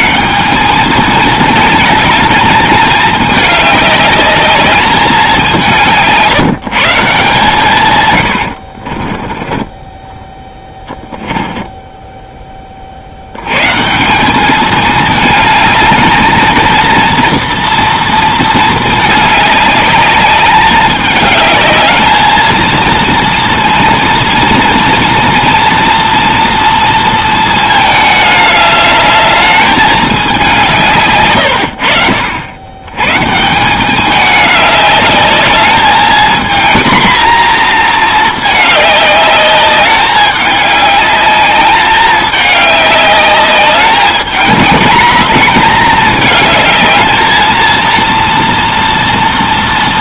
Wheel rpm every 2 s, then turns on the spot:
200, 210, 210, 160, 60, 10, 40, 210, 230, 220, 210, 230, 230, 230, 210, 180, 110, 210, 230, 210, 200, 210, 220, 220, 230.
8-12